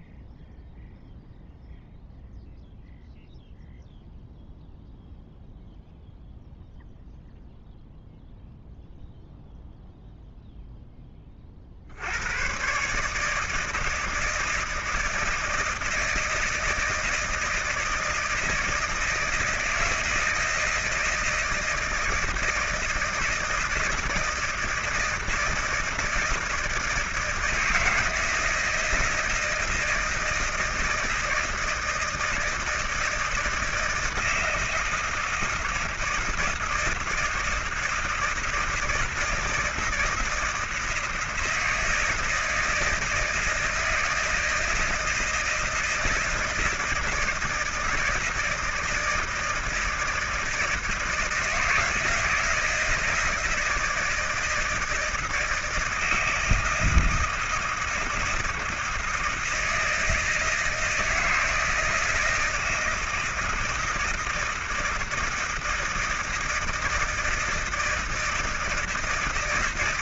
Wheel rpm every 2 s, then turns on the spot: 0, 0, 0, 0, 0, 0, 130, 160, 160, 160, 160, 160, 160, 160, 160, 160, 160, 160, 170, 160, 160, 160, 160, 160, 160, 160, 160, 170, 160, 160, 160, 160, 160, 160, 160.
none